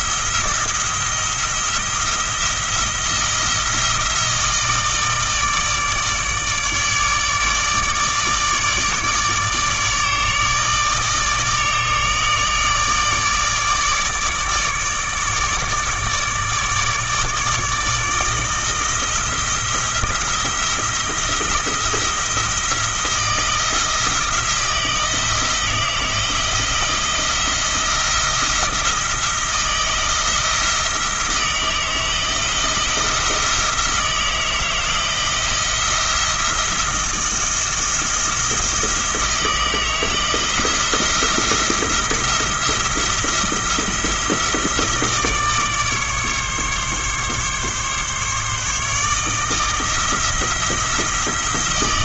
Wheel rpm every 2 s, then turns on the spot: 170, 170, 160, 150, 150, 150, 150, 150, 150, 160, 170, 170, 170, 170, 170, 160, 170, 160, 170, 160, 170, 170, 160, 140, 150, 160.
none